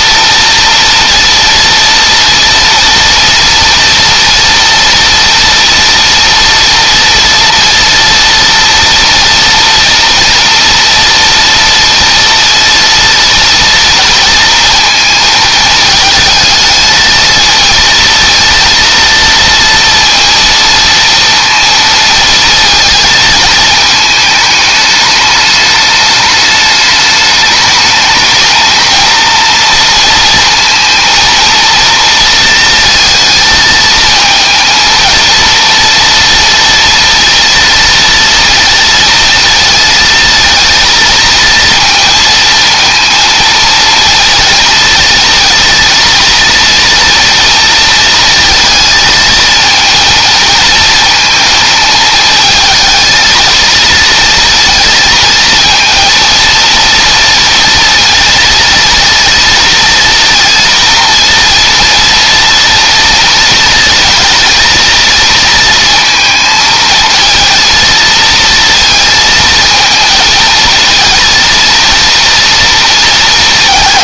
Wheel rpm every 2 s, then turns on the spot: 230, 230, 230, 230, 230, 230, 230, 220, 220, 230, 230, 220, 210, 210, 220, 230, 230, 230, 230, 230, 230, 230, 230, 230, 220, 220, 220, 230, 230, 230, 230, 230, 230, 220, 230, 230, 230.
none